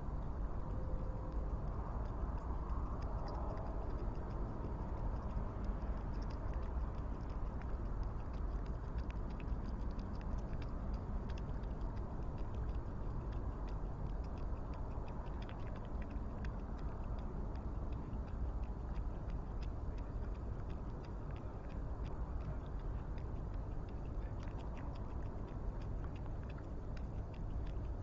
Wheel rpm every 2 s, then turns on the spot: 0, 0, 0, 0, 0, 0, 0, 0, 0, 0, 0, 0, 0, 0.
none